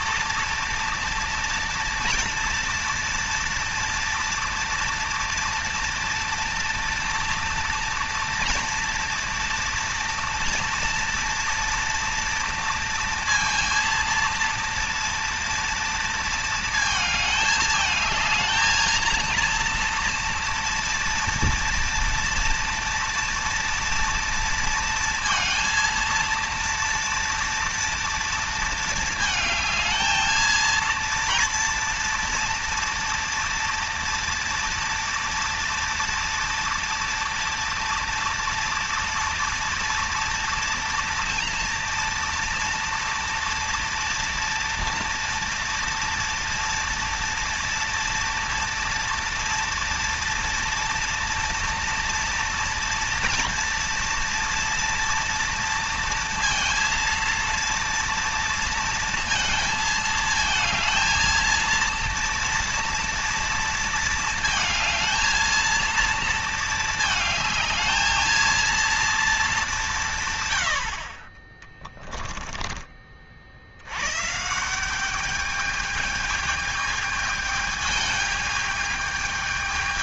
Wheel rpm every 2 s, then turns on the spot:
240, 230, 230, 230, 230, 230, 230, 230, 220, 230, 230, 230, 230, 230, 230, 230, 230, 240, 230, 230, 230, 230, 240, 230, 230, 230, 230, 230, 230, 230, 220, 230, 220, 220, 230, 70, 30, 190, 210, 210.
none